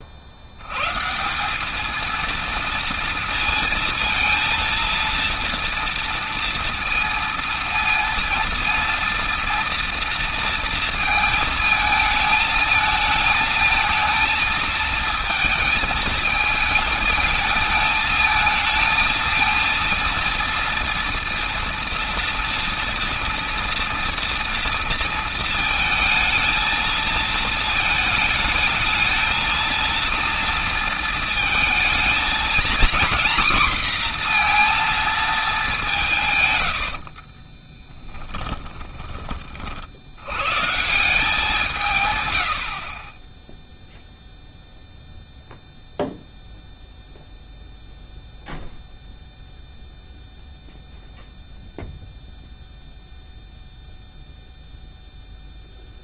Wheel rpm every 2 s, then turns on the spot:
70, 230, 230, 230, 230, 230, 220, 220, 220, 220, 230, 230, 230, 230, 220, 230, 220, 230, 130, 20, 110, 90, 0, 0, 0, 0, 0, 0.
36-40